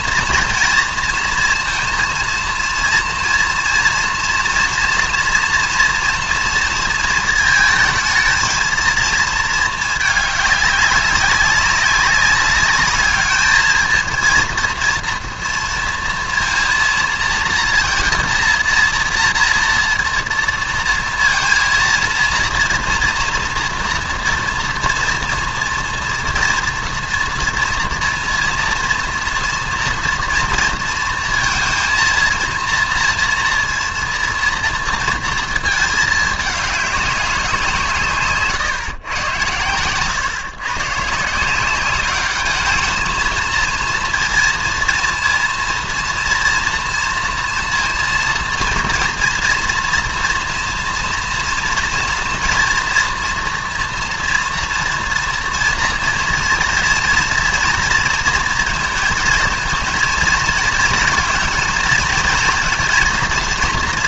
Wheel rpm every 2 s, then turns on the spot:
230, 230, 230, 230, 230, 200, 200, 230, 230, 230, 230, 230, 230, 230, 230, 230, 230, 230, 210, 140, 120, 210, 230, 230, 230, 230, 230, 230, 240, 230, 230, 230.
none